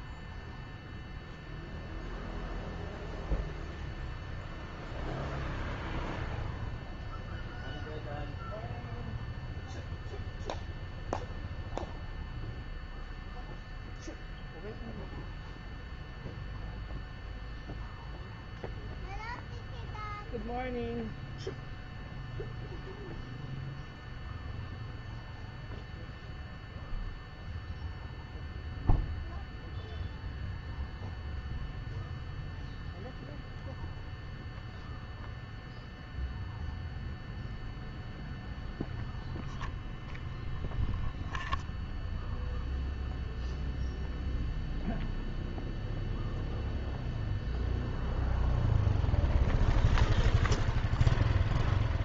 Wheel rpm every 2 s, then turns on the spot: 0, 0, 0, 0, 0, 0, 0, 0, 0, 0, 0, 0, 0, 0, 0, 0, 0, 0, 0, 0, 0, 0, 0, 0, 0, 0.
none